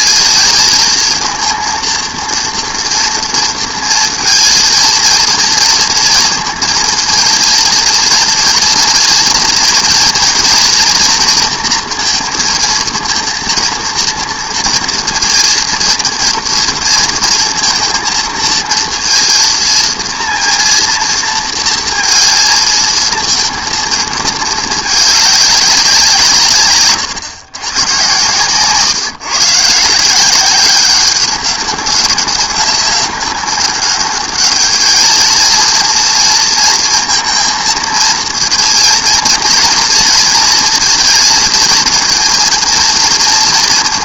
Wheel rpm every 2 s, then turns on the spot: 220, 230, 230, 230, 230, 240, 230, 230, 230, 230, 230, 230, 210, 130, 140, 190, 190, 210, 230, 230, 220, 230.
none